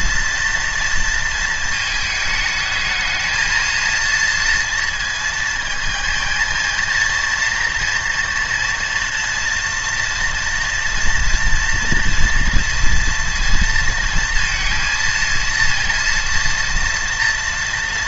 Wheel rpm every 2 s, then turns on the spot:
230, 220, 230, 230, 230, 230, 230, 230, 230.
none